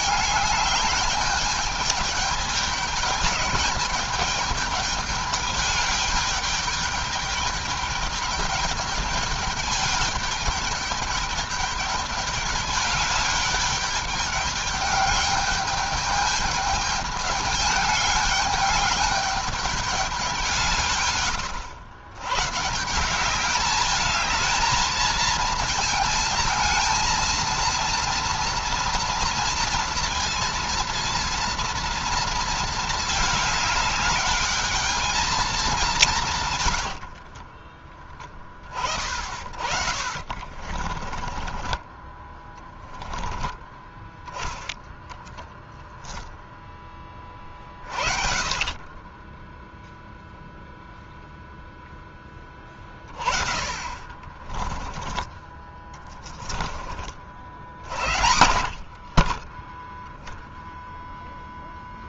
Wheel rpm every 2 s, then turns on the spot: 210, 210, 210, 210, 210, 210, 200, 210, 210, 210, 140, 170, 230, 230, 230, 230, 220, 220, 70, 30, 40, 10, 10, 20, 20, 0, 30, 30, 30, 40, 0.
36-38 40-42 52-56